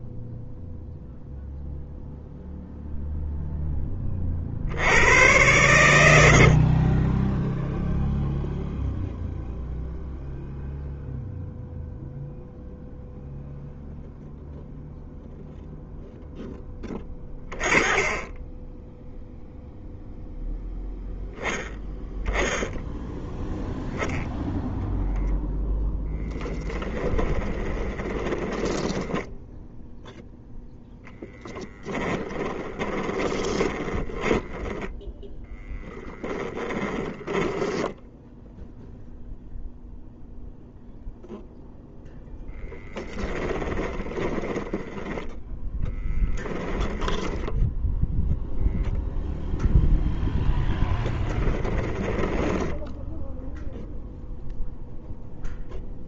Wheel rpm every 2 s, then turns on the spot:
0, 0, 90, 30, 0, 0, 0, 0, 10, 0, 0, 0, 0, 10, 10, 10, 20, 10, 10, 0, 0, 10, 10, 10, 0, 10, 10, 0.
26-38 42-48 50-54